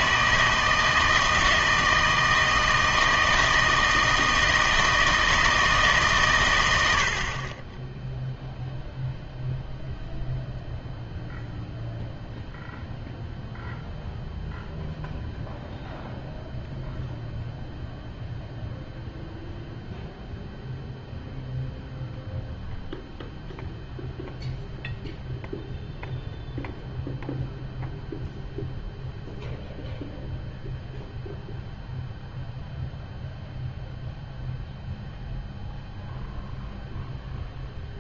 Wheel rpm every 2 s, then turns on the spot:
160, 160, 160, 90, 0, 0, 0, 0, 0, 0, 0, 0, 0, 0, 0, 0, 0, 0, 0.
none